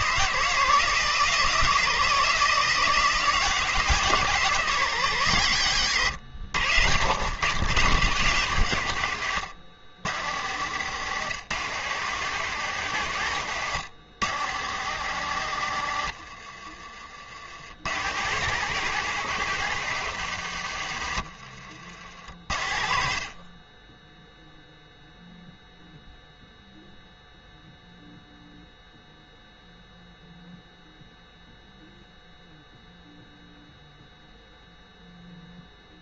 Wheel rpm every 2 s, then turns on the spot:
160, 160, 150, 90, 120, 110, 130, 120, 50, 140, 90, 60, 0, 0, 0, 0, 0, 0.
16-18